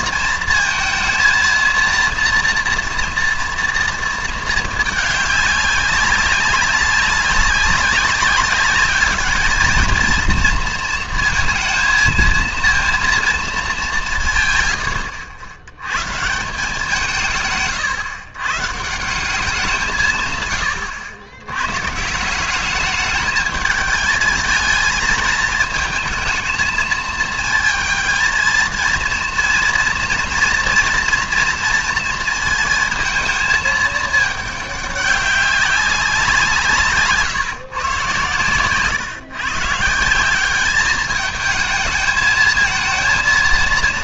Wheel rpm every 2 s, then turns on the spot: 220, 230, 220, 190, 210, 220, 230, 140, 160, 140, 110, 200, 210, 220, 230, 230, 230, 210, 170, 140, 200, 220.
none